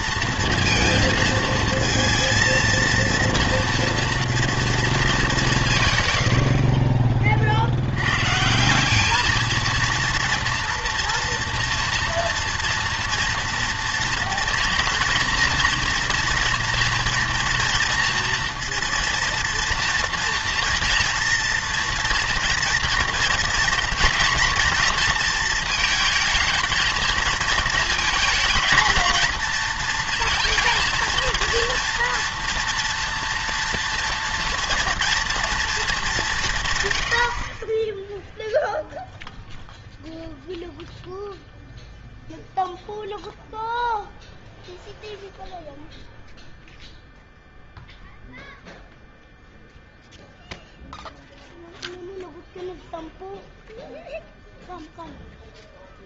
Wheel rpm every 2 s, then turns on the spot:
230, 230, 230, 60, 170, 230, 230, 230, 230, 230, 230, 240, 230, 230, 220, 230, 230, 240, 150, 0, 0, 0, 0, 0, 0, 0, 0, 0.
none